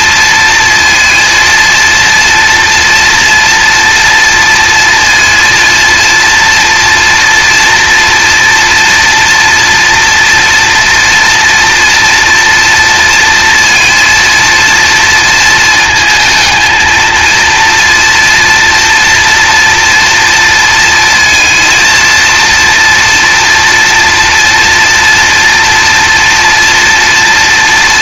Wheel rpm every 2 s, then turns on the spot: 230, 230, 230, 240, 230, 230, 230, 230, 220, 230, 230, 230, 230, 230.
none